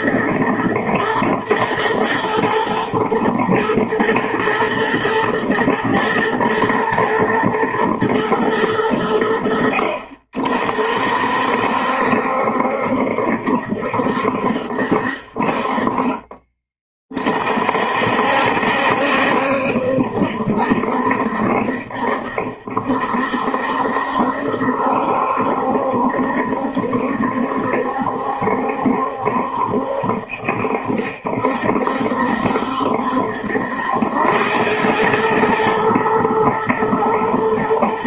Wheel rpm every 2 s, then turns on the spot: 110, 120, 110, 110, 100, 50, 70, 70, 30, 70, 70, 70, 70, 70, 70, 70, 70, 100, 120.
none